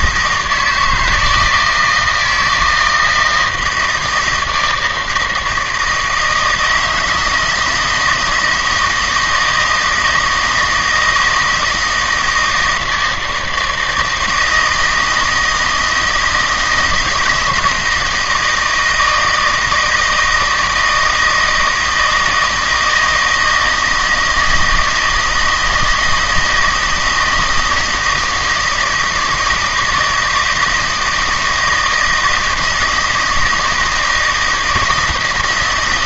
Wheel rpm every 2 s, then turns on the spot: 160, 160, 160, 160, 160, 160, 160, 160, 170, 160, 160, 160, 160, 160, 160, 160, 160, 160.
none